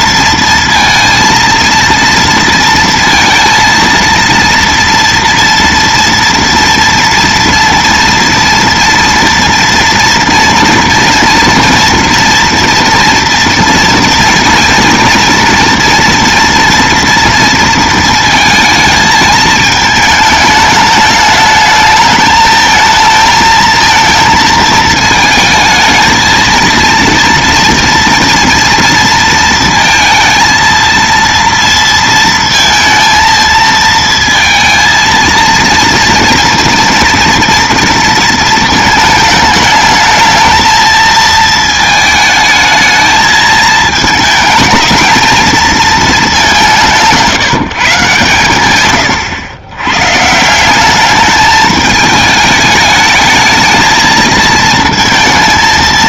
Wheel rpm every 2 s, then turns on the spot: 230, 230, 230, 230, 230, 230, 230, 230, 230, 220, 210, 220, 220, 230, 230, 230, 230, 230, 230, 220, 220, 220, 220, 160, 100, 190, 210, 220.
none